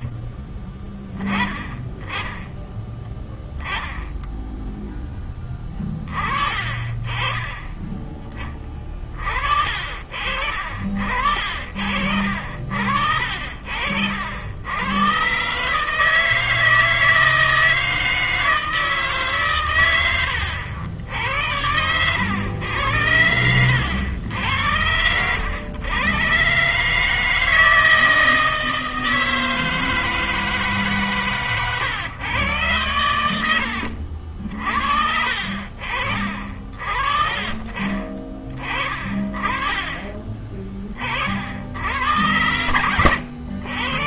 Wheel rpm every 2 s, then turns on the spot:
20, 10, 10, 30, 20, 50, 60, 100, 160, 160, 80, 100, 90, 140, 160, 150, 110, 60, 40, 40, 20, 100.
none